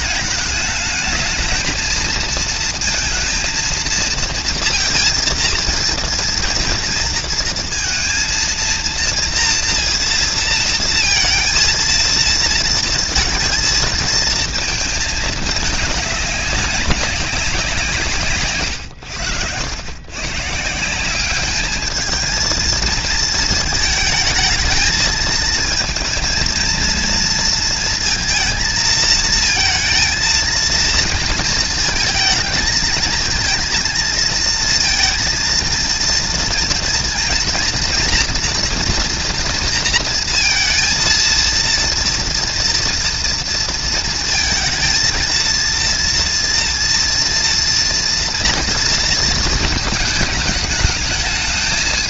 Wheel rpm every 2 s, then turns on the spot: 220, 230, 230, 230, 230, 230, 230, 220, 190, 100, 170, 220, 220, 230, 220, 230, 220, 230, 230, 240, 230, 230, 220, 230, 230, 210.
none